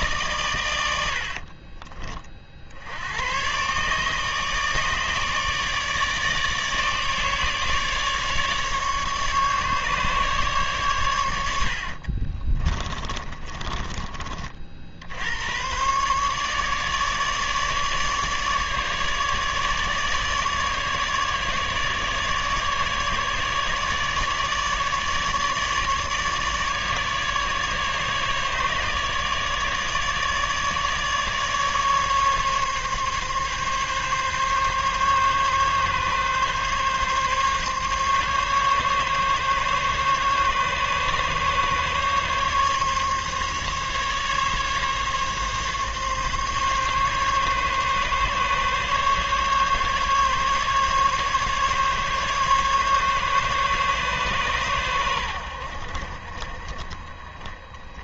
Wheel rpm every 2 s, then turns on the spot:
110, 60, 150, 150, 150, 130, 40, 50, 150, 150, 150, 150, 150, 150, 150, 150, 140, 140, 140, 140, 140, 140, 140, 140, 140, 140, 140, 120, 40.
12-14